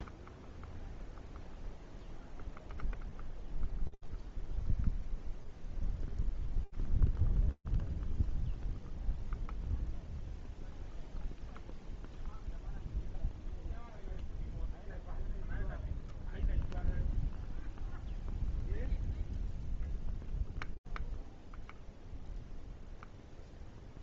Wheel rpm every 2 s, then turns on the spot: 0, 0, 0, 0, 0, 0, 0, 0, 0, 0, 0, 0.
none